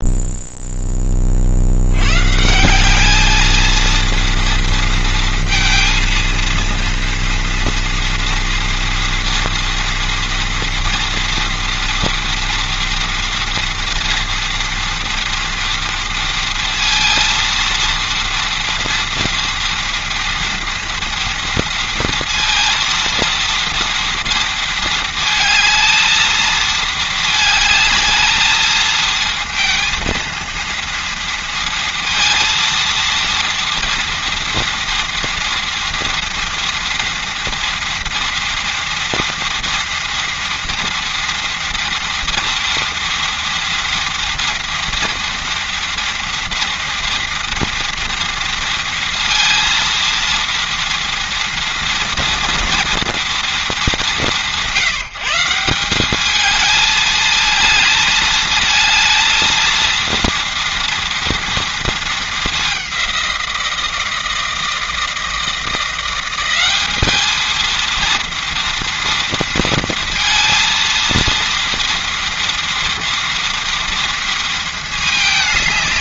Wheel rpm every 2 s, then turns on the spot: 20, 210, 230, 230, 230, 240, 230, 230, 230, 230, 230, 230, 220, 220, 220, 230, 230, 230, 230, 230, 230, 230, 230, 230, 230, 230, 230, 170, 220, 220, 230, 190, 160, 210, 230, 230, 240, 210.
none